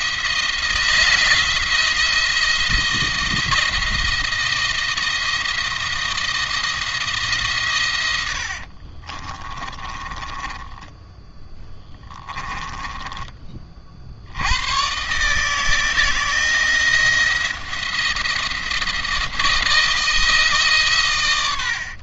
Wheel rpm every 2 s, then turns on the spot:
170, 170, 170, 160, 40, 10, 20, 130, 170, 170, 140.
8-12